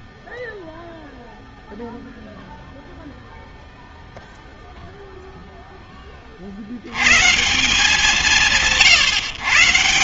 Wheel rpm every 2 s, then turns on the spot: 0, 0, 0, 160, 150.
none